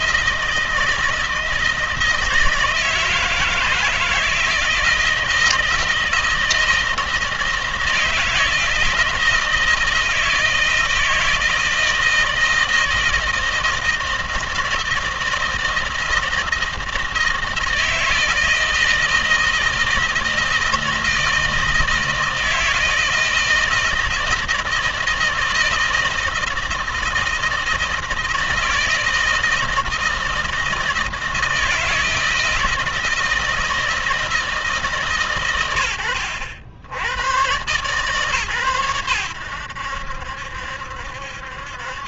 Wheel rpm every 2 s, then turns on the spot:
160, 160, 160, 160, 160, 160, 160, 160, 160, 160, 160, 160, 160, 160, 160, 160, 160, 150, 80, 110, 70.
none